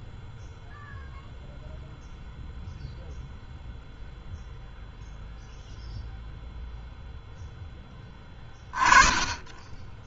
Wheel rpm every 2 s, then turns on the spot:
0, 0, 0, 10, 0.
none